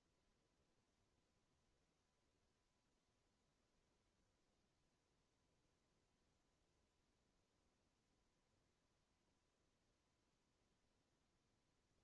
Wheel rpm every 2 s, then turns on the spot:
0, 0, 0, 0, 0, 0.
none